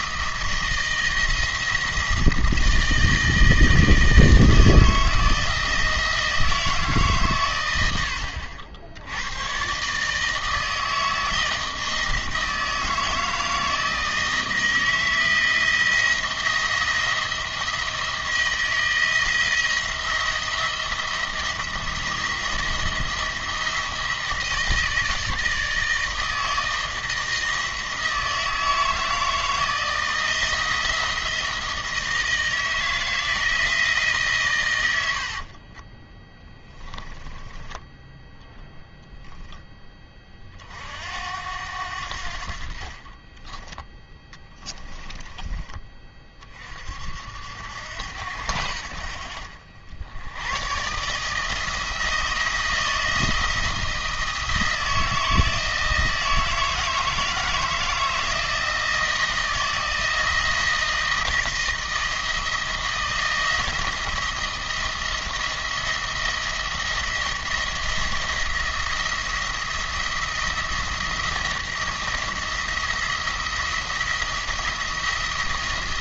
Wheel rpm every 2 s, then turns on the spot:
160, 160, 160, 160, 70, 160, 160, 160, 160, 160, 170, 170, 160, 160, 160, 160, 160, 110, 20, 0, 50, 50, 10, 50, 80, 110, 170, 160, 160, 160, 160, 160, 170, 170, 170, 170, 160, 170.
36-38 44-46